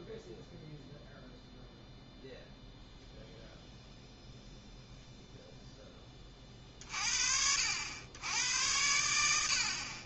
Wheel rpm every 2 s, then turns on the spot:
0, 0, 0, 40, 80.
none